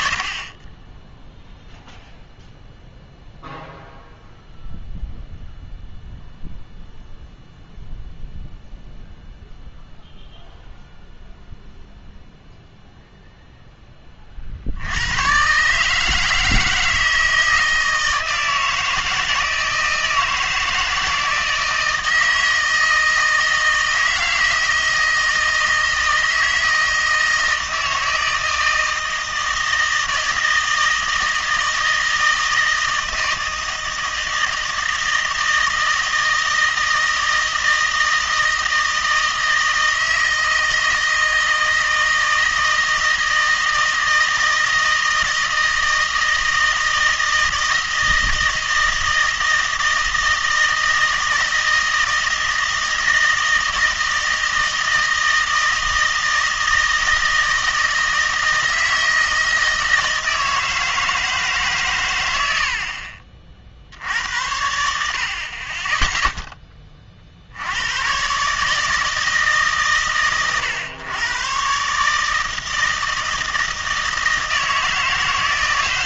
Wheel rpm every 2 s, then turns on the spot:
50, 0, 0, 0, 0, 0, 0, 50, 160, 160, 160, 160, 160, 160, 160, 160, 160, 160, 160, 160, 160, 160, 160, 160, 160, 160, 160, 160, 160, 160, 160, 80, 80, 10, 140, 120, 160, 160.
none